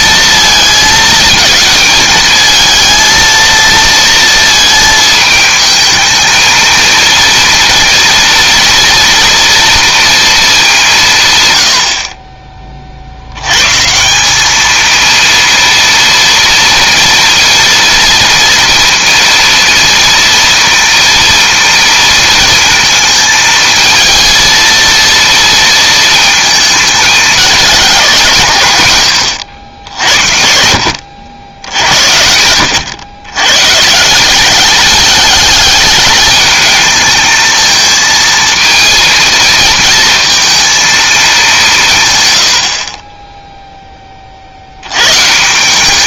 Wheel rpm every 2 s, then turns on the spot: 230, 230, 220, 230, 230, 200, 40, 220, 230, 230, 230, 230, 230, 220, 130, 70, 100, 200, 220, 230, 230, 60, 80.
none